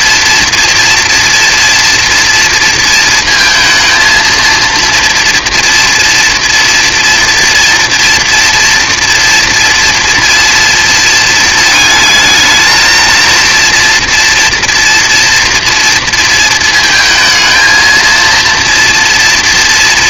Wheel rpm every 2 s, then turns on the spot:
230, 230, 230, 230, 230, 230, 220, 230, 230, 230.
none